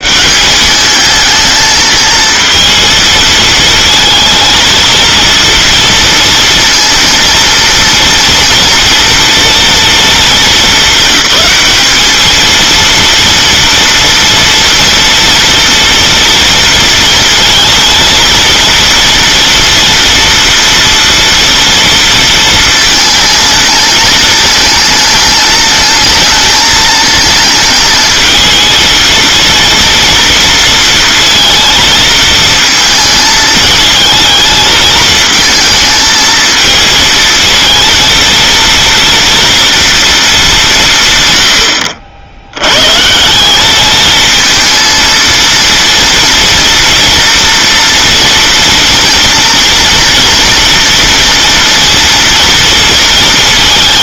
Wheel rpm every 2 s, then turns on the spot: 200, 220, 230, 230, 230, 210, 230, 230, 230, 230, 230, 220, 220, 220, 230, 230, 220, 220, 220, 230, 170, 120, 230, 230, 230, 240, 230.
none